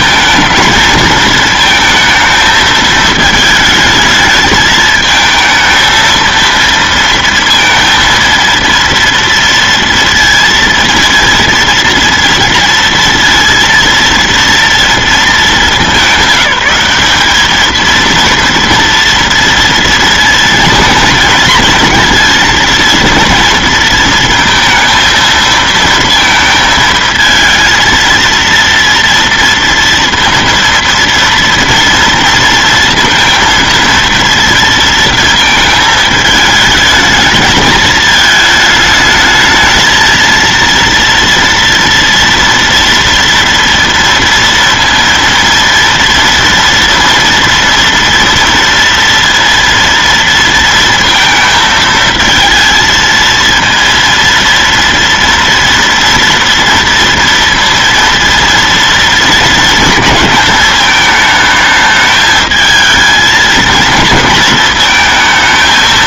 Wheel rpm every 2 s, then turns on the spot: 230, 220, 220, 230, 230, 230, 230, 230, 190, 230, 230, 230, 230, 230, 230, 230, 230, 230, 220, 220, 230, 230, 230, 230, 230, 230, 220, 230, 230, 230, 220, 220, 230.
none